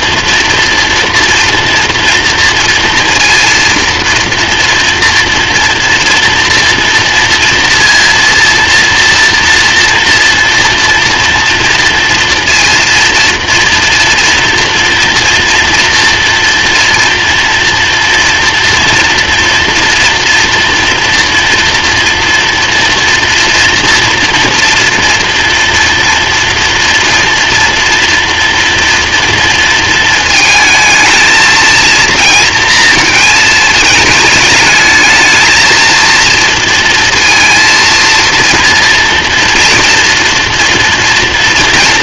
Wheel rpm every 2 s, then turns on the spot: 230, 230, 230, 230, 230, 230, 230, 230, 230, 230, 230, 230, 230, 240, 230, 220, 230, 220, 230, 230, 240.
none